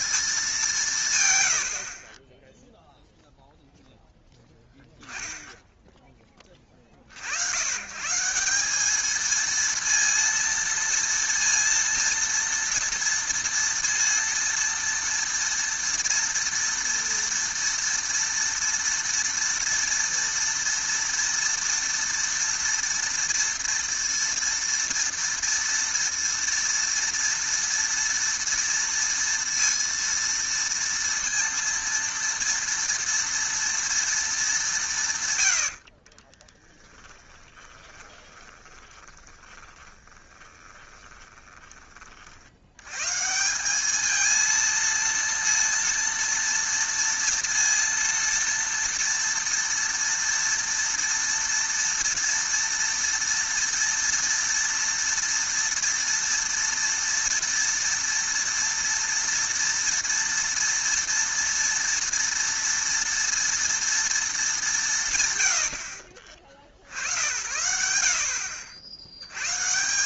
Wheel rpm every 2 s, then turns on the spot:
200, 10, 10, 40, 200, 230, 230, 230, 230, 230, 230, 240, 230, 230, 230, 230, 230, 130, 10, 20, 20, 90, 230, 230, 230, 230, 230, 230, 230, 230, 230, 230, 200, 60, 70.
36-42